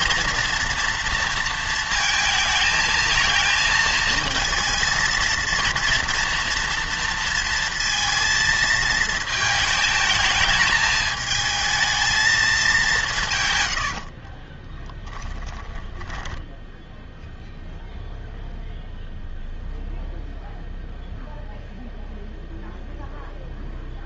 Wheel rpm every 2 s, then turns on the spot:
230, 220, 230, 230, 220, 210, 200, 10, 10, 0, 0, 0.
14-18